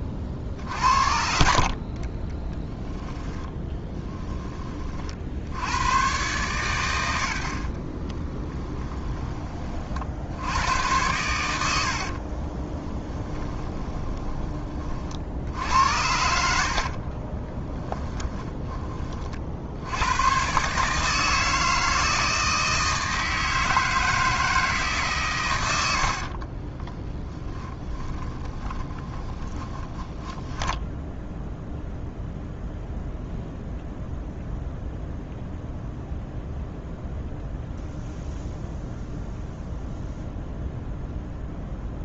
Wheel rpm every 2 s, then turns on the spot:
40, 10, 20, 110, 10, 100, 20, 30, 70, 20, 140, 160, 150, 30, 20, 10, 0, 0, 0, 0, 0.
2-4 8-10 12-14 16-18 26-30